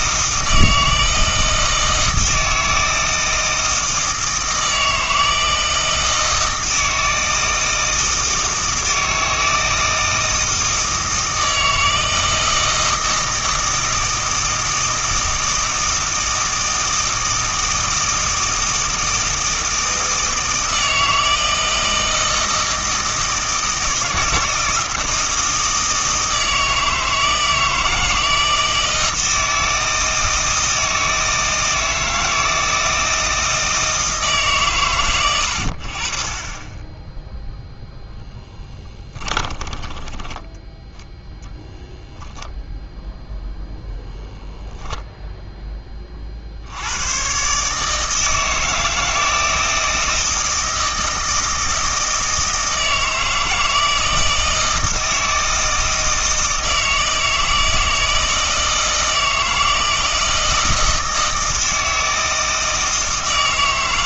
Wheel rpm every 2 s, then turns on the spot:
160, 160, 160, 160, 160, 160, 160, 160, 160, 160, 160, 160, 160, 160, 160, 160, 160, 130, 20, 10, 10, 0, 0, 80, 160, 160, 160, 160, 160, 160, 160, 160.
38-40